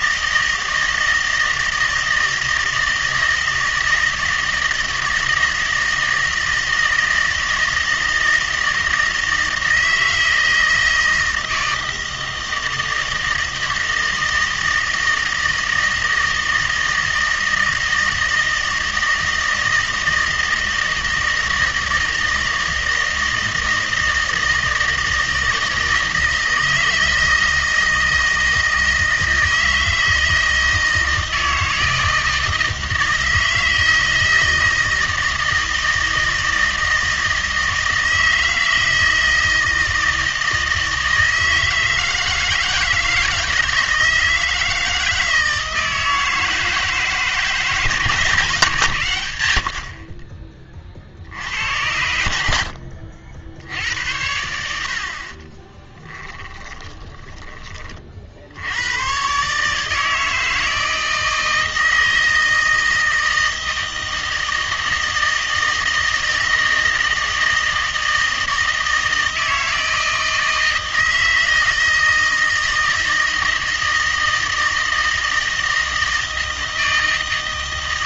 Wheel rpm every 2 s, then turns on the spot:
160, 160, 160, 160, 160, 160, 160, 160, 160, 160, 160, 160, 160, 160, 160, 160, 160, 160, 160, 160, 160, 160, 160, 160, 140, 30, 70, 70, 20, 90, 160, 160, 160, 160, 160, 160, 160, 160, 160.
56-58